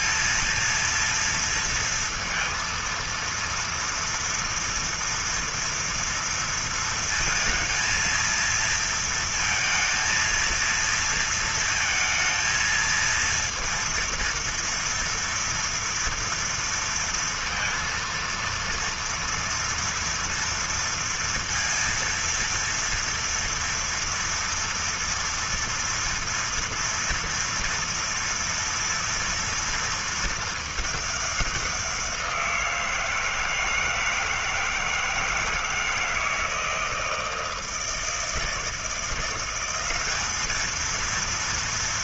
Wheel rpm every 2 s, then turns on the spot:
230, 230, 230, 230, 230, 230, 230, 230, 230, 230, 230, 230, 230, 230, 230, 210, 170, 160, 160, 170, 220.
none